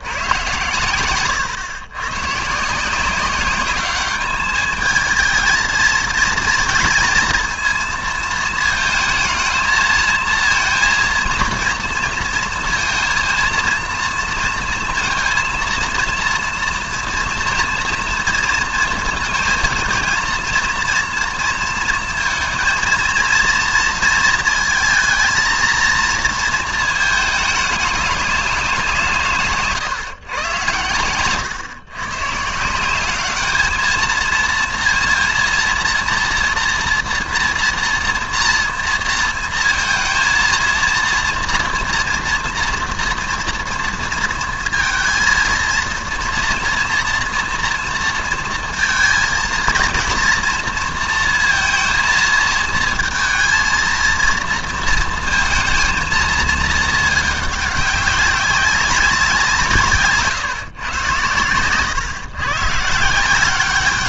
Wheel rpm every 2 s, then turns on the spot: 120, 150, 210, 230, 220, 230, 230, 230, 230, 230, 230, 230, 220, 230, 190, 120, 160, 230, 240, 230, 230, 240, 230, 230, 230, 240, 230, 230, 220, 190, 130, 130.
none